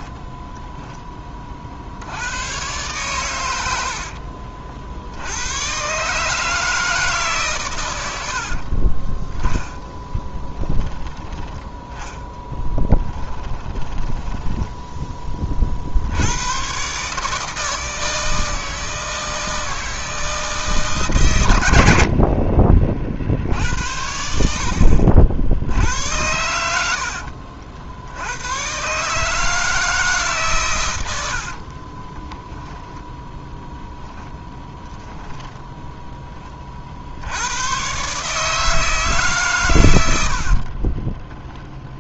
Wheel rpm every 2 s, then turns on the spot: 10, 120, 50, 160, 30, 10, 10, 10, 130, 160, 150, 50, 70, 70, 130, 100, 0, 10, 60, 160, 50.
8-10 12-14 34-36 40-42